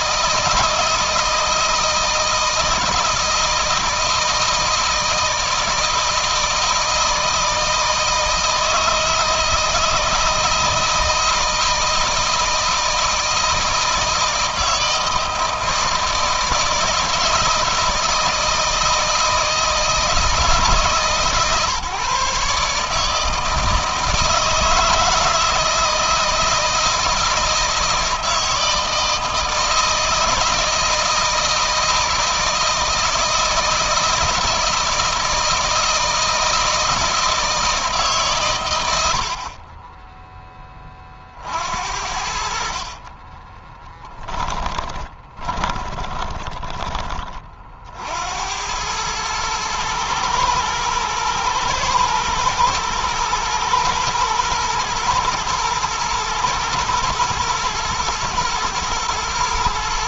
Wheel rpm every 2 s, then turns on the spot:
160, 160, 160, 160, 160, 160, 160, 160, 160, 160, 150, 150, 160, 160, 160, 160, 160, 160, 160, 100, 30, 60, 20, 20, 90, 110, 120, 110, 110, 110.
42-46